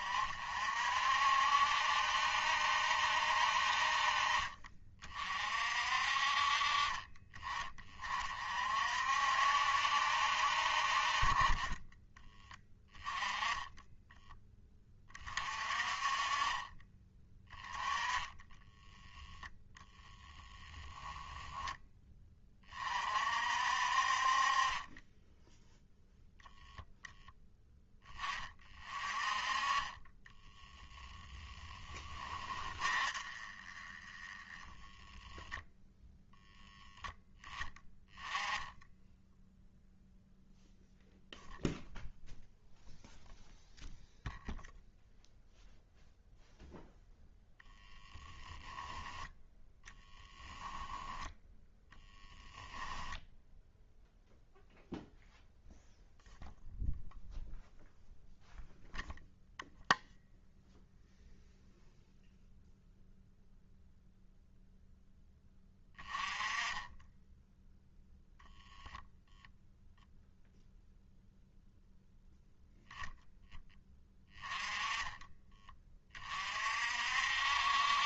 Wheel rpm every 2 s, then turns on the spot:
50, 70, 40, 40, 50, 40, 20, 30, 30, 10, 10, 40, 20, 0, 30, 10, 30, 10, 10, 10, 0, 0, 0, 0, 10, 0, 10, 0, 0, 0, 0, 0, 0, 10, 0, 0, 0, 20, 50.
30-34 74-76